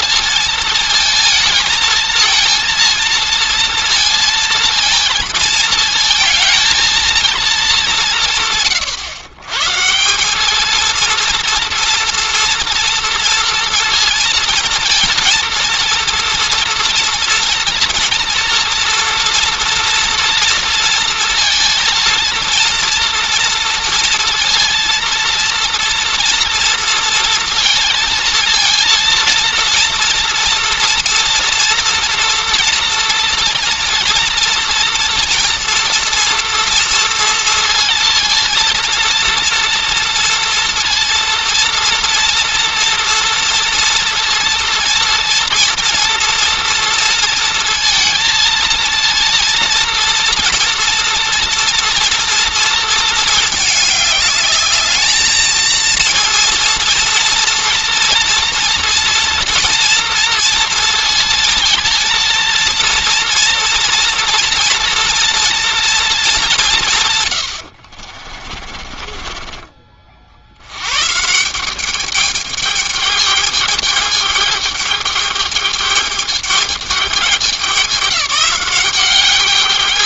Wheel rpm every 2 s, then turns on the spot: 230, 220, 230, 220, 140, 230, 230, 230, 230, 230, 230, 230, 230, 230, 230, 230, 230, 230, 230, 230, 230, 230, 230, 230, 230, 230, 230, 210, 230, 230, 230, 230, 230, 170, 40, 110, 210, 210, 210, 180.
68-70